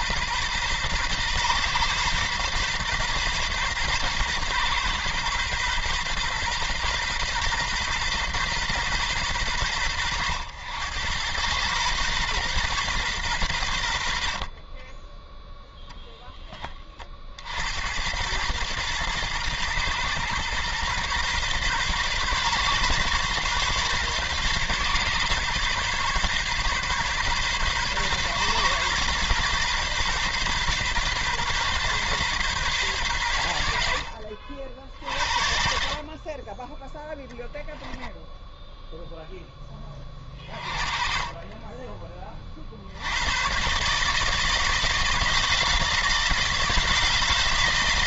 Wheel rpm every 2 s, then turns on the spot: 130, 130, 130, 130, 130, 100, 120, 50, 30, 110, 120, 130, 130, 130, 130, 130, 130, 50, 20, 10, 30, 70, 160, 160.
none